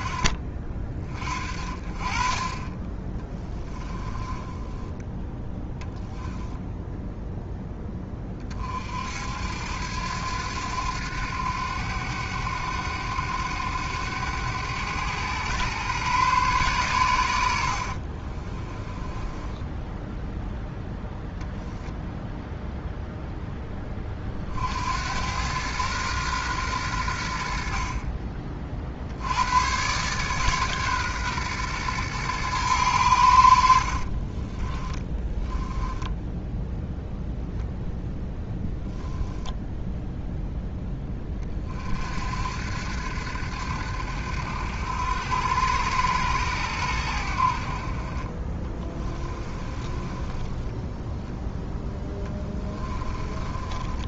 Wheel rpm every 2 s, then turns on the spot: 40, 30, 10, 10, 30, 90, 90, 100, 130, 30, 0, 0, 50, 120, 40, 140, 120, 30, 0, 0, 0, 60, 80, 110, 20, 10, 10.
4-6 18-20 34-36 50-54